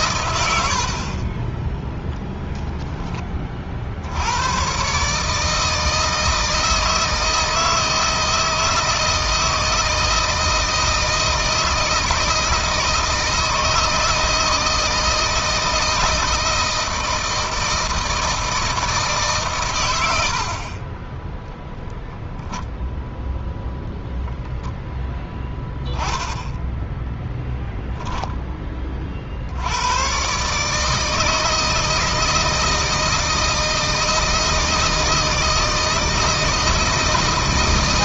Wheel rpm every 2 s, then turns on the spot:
80, 10, 120, 160, 160, 160, 160, 160, 160, 160, 40, 0, 10, 10, 20, 140, 160, 160, 160.
none